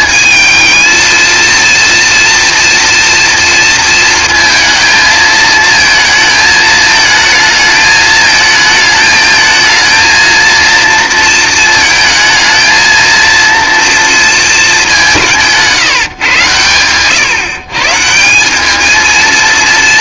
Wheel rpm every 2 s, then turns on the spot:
230, 230, 220, 220, 220, 230, 230, 200, 120, 210.
none